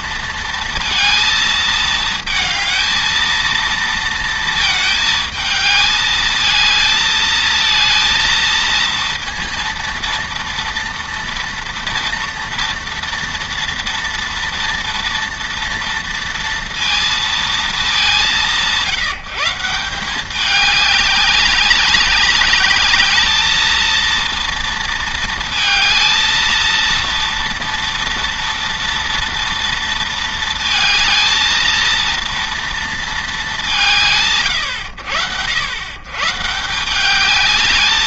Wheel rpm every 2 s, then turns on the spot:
230, 220, 220, 220, 230, 230, 230, 230, 230, 160, 200, 200, 230, 230, 230, 230, 230, 100, 160.
none